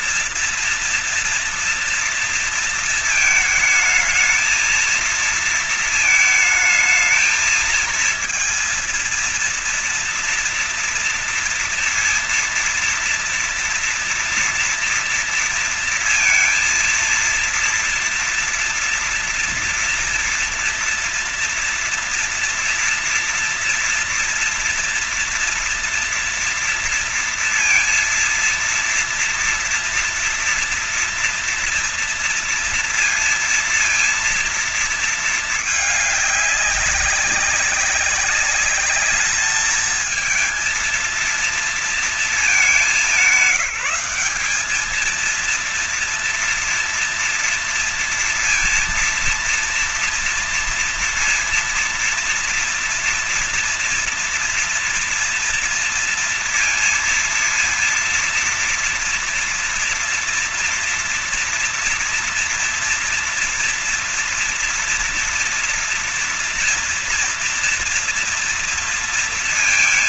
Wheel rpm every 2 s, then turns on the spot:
230, 230, 220, 220, 220, 230, 230, 240, 230, 230, 230, 240, 240, 230, 230, 240, 230, 230, 210, 200, 220, 220, 210, 230, 230, 230, 230, 230, 230, 230, 230, 240, 240, 230, 230.
none